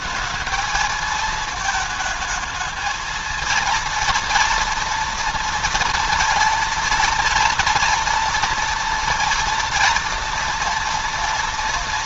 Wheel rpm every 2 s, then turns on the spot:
220, 220, 230, 230, 230, 230.
none